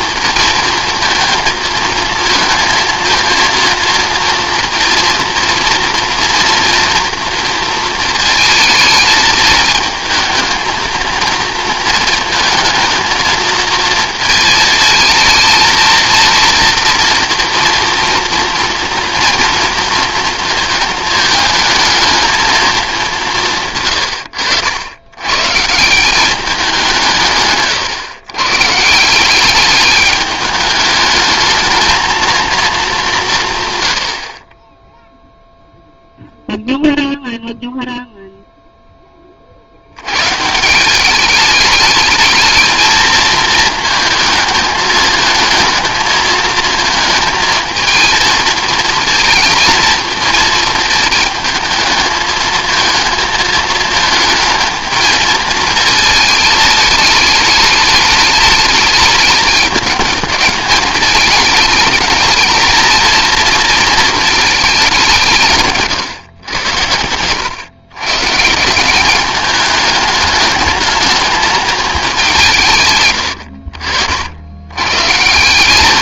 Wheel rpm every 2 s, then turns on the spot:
230, 230, 230, 240, 220, 220, 220, 220, 230, 230, 220, 220, 80, 190, 130, 210, 220, 30, 0, 0, 160, 220, 220, 230, 220, 220, 220, 220, 220, 210, 210, 220, 210, 110, 160, 210, 160, 100.
none